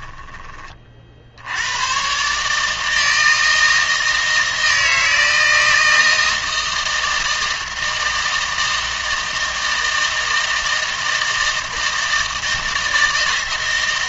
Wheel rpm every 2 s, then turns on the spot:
40, 160, 160, 160, 160, 160, 160.
none